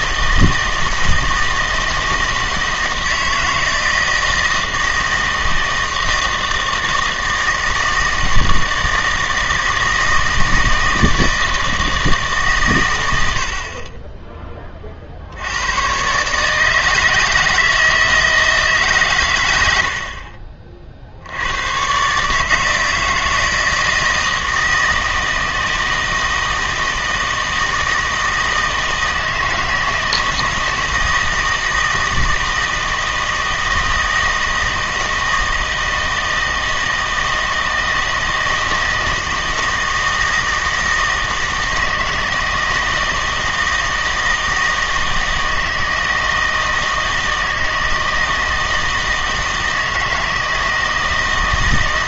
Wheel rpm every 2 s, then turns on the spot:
160, 160, 160, 160, 160, 160, 130, 30, 150, 160, 40, 160, 160, 160, 160, 160, 160, 160, 160, 160, 160, 160, 160, 160, 160, 160.
none